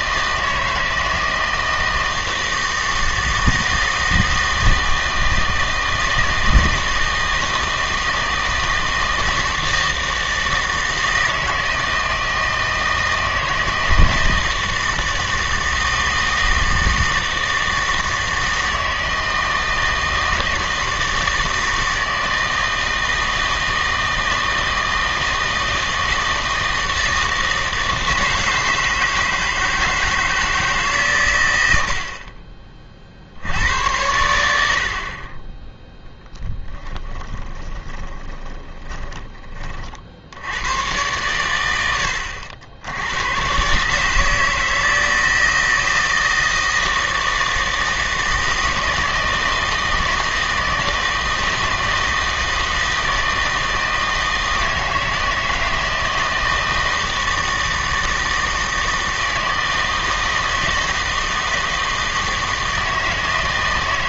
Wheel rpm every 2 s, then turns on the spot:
160, 160, 160, 160, 160, 160, 160, 160, 160, 160, 160, 160, 160, 160, 160, 160, 40, 60, 10, 20, 100, 80, 160, 160, 160, 160, 160, 160, 160, 160, 160, 160.
36-40